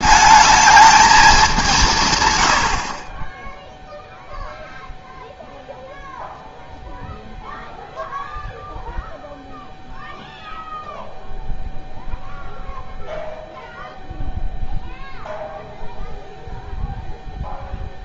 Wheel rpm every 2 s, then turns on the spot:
220, 80, 0, 0, 0, 0, 0, 0, 0.
none